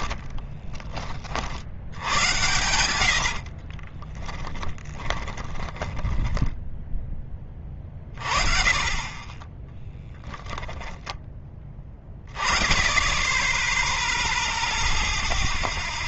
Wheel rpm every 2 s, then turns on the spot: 40, 80, 10, 20, 30, 10, 10, 0.
2-6